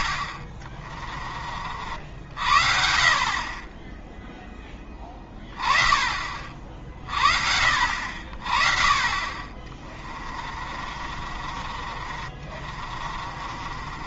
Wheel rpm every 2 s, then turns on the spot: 20, 60, 10, 40, 40, 40, 40.
0-2 6-8 10-14